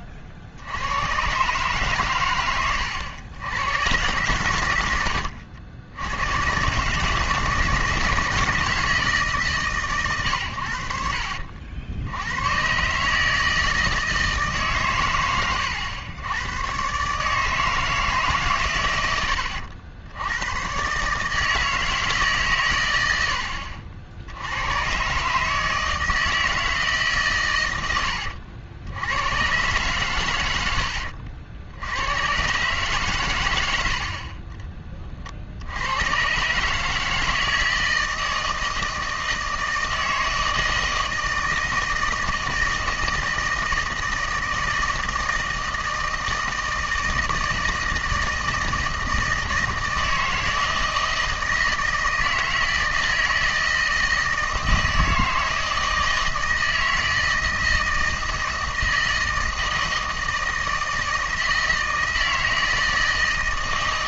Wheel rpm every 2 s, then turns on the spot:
70, 110, 100, 130, 160, 80, 120, 140, 110, 130, 110, 130, 90, 160, 80, 90, 140, 40, 140, 160, 160, 160, 160, 160, 160, 160, 160, 160, 160, 160, 160, 160.
none